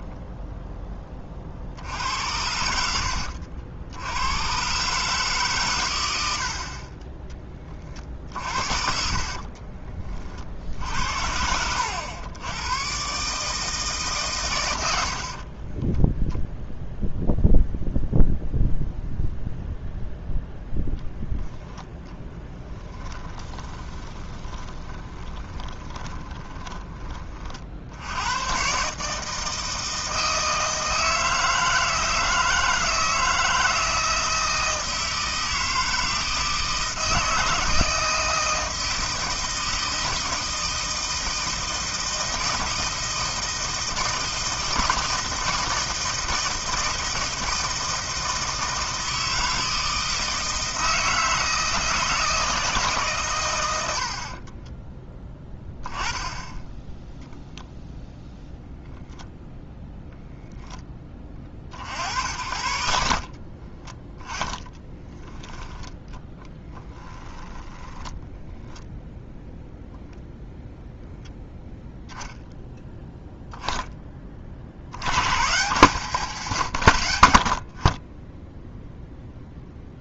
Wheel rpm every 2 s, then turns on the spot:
0, 60, 80, 120, 30, 40, 90, 150, 20, 0, 0, 10, 20, 20, 50, 160, 160, 160, 160, 160, 160, 160, 160, 160, 160, 160, 160, 90, 10, 0, 0, 50, 20, 10, 10, 0, 0, 10, 140, 40.
10-12 16-18 22-28 64-66 68-70